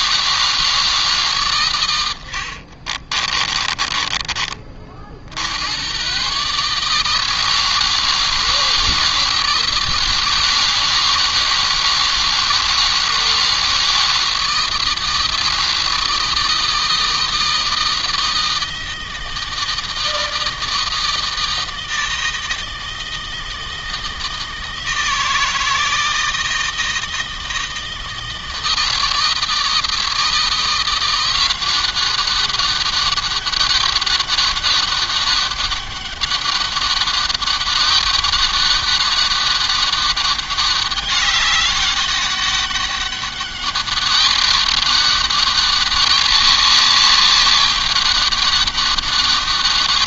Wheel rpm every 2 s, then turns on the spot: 150, 40, 50, 160, 160, 160, 160, 160, 160, 160, 160, 160, 160, 160, 160, 170, 200, 200, 200, 200, 200, 200, 200, 200, 200.
2-4